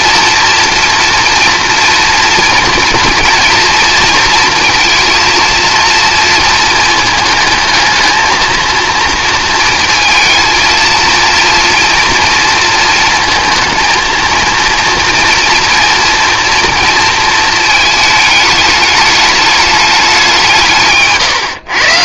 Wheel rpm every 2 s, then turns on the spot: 230, 230, 230, 230, 230, 230, 230, 230, 230, 210, 150.
none